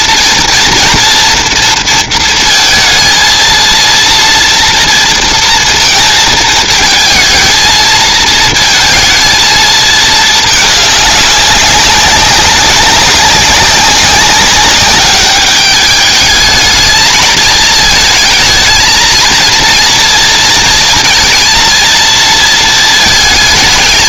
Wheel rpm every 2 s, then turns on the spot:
230, 230, 230, 220, 230, 210, 190, 200, 220, 230, 230, 230.
none